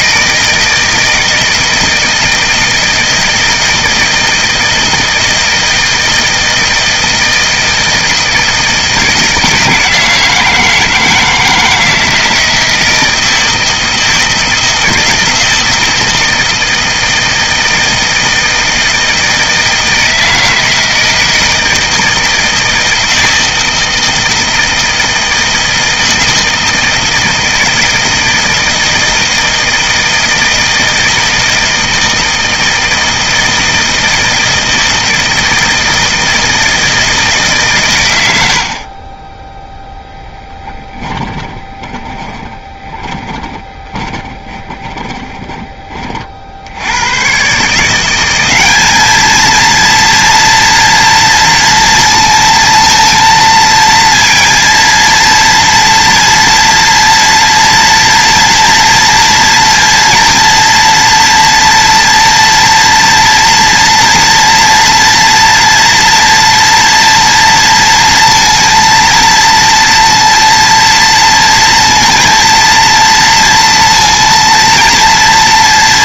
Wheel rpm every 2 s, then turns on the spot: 160, 160, 160, 160, 160, 160, 160, 160, 160, 160, 160, 160, 160, 160, 160, 160, 160, 160, 160, 30, 20, 10, 20, 90, 210, 230, 230, 230, 230, 230, 230, 230, 230, 230, 230, 230, 230, 230.
38-46